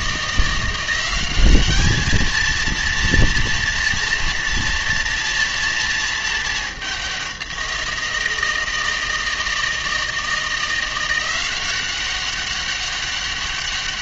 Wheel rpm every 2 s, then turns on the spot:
180, 230, 230, 200, 160, 170, 200.
none